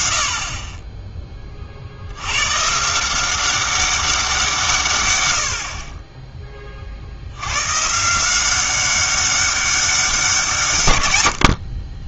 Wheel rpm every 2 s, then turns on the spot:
40, 140, 150, 30, 190, 170.
none